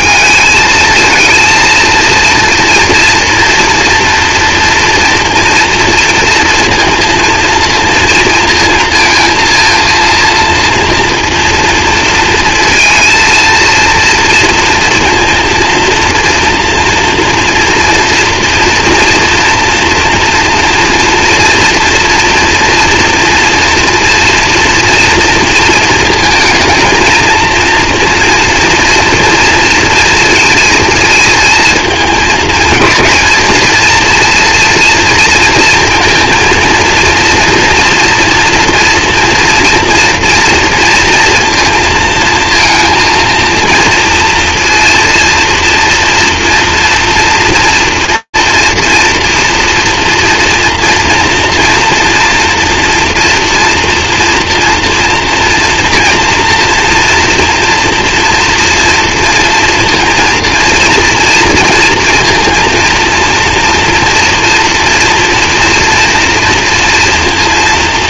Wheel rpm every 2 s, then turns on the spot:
220, 230, 230, 230, 230, 230, 230, 230, 230, 230, 230, 240, 230, 230, 230, 230, 220, 220, 230, 230, 230, 230, 230, 230, 240, 230, 230, 230, 230, 230, 230, 230, 230, 230.
none